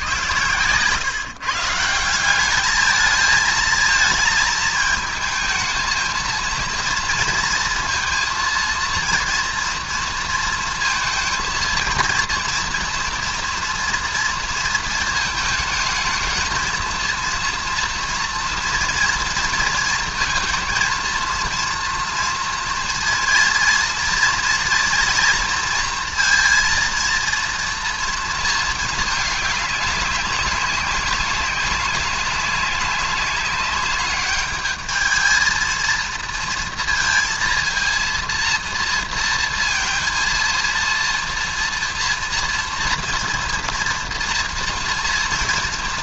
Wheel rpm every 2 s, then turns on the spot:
110, 180, 220, 230, 230, 230, 230, 230, 220, 230, 230, 230, 230, 230, 230, 200, 200, 200, 230, 230, 230, 230, 230.
none